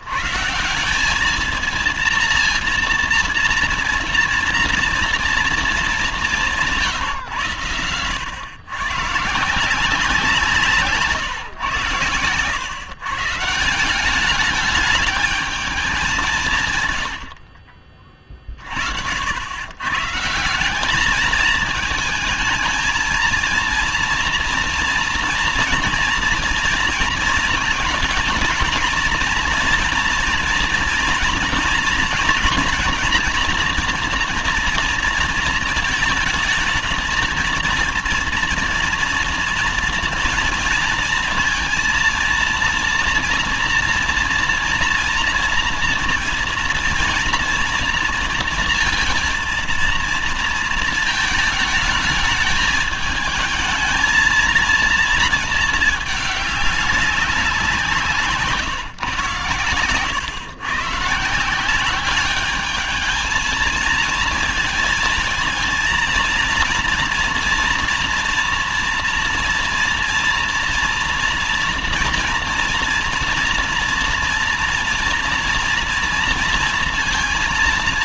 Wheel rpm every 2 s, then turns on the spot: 160, 230, 230, 170, 110, 160, 110, 210, 140, 50, 180, 220, 230, 230, 230, 240, 230, 230, 220, 230, 230, 230, 230, 230, 230, 220, 220, 230, 200, 160, 130, 210, 230, 230, 230, 230, 230, 230, 230.
none